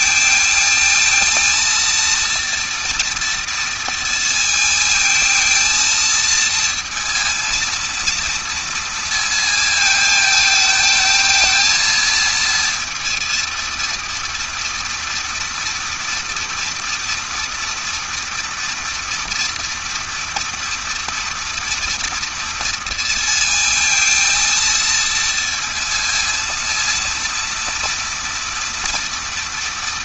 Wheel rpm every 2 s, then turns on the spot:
220, 230, 220, 230, 230, 220, 230, 230, 230, 230, 230, 230, 230, 230, 230.
none